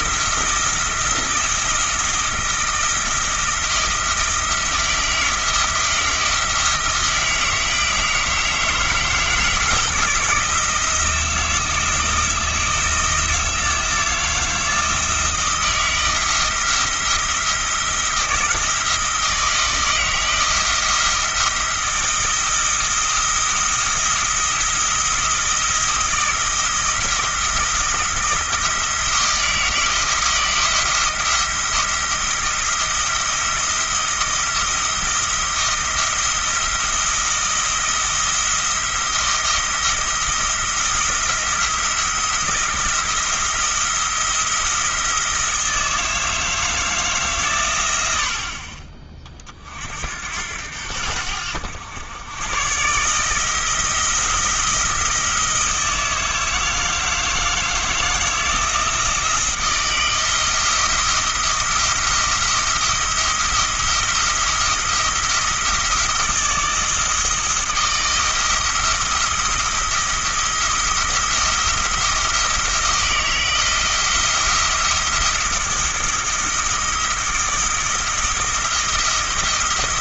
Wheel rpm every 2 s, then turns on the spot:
170, 160, 160, 160, 160, 170, 170, 170, 170, 170, 170, 160, 160, 170, 160, 170, 170, 160, 170, 170, 170, 170, 170, 160, 30, 80, 130, 170, 160, 170, 170, 170, 170, 160, 170, 170, 160, 170, 170, 170.
none